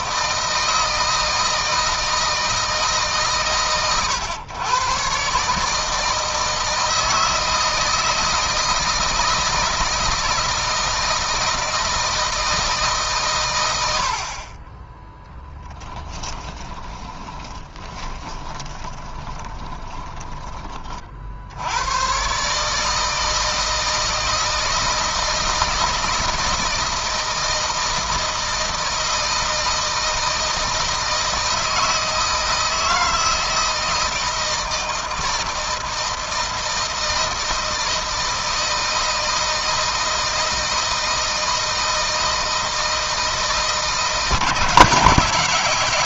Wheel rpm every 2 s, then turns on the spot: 160, 160, 120, 160, 160, 160, 160, 40, 20, 10, 20, 140, 160, 160, 160, 160, 160, 160, 160, 160, 160, 160, 160.
16-20